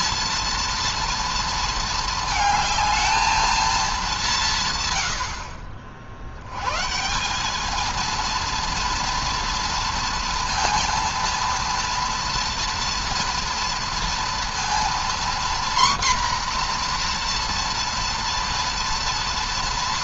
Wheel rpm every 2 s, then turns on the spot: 230, 220, 160, 100, 230, 230, 230, 230, 250, 240.
none